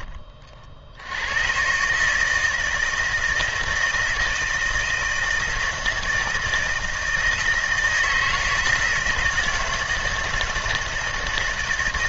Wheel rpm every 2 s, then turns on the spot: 70, 160, 160, 160, 160, 160.
none